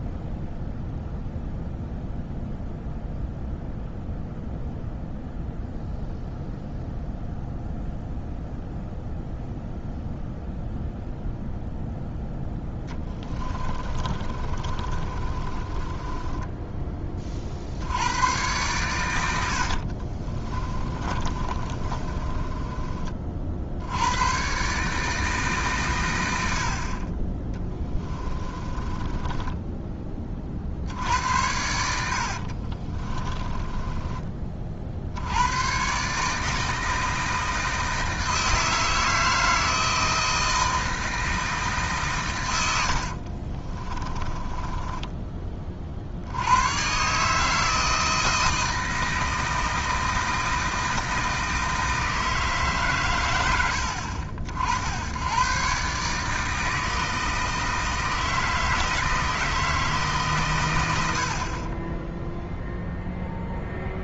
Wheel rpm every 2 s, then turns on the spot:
0, 0, 0, 0, 0, 0, 10, 30, 20, 110, 30, 30, 140, 50, 20, 70, 30, 50, 160, 160, 160, 90, 20, 130, 160, 160, 140, 80, 160, 160, 110, 0.
12-16 20-24 28-30 32-34 42-46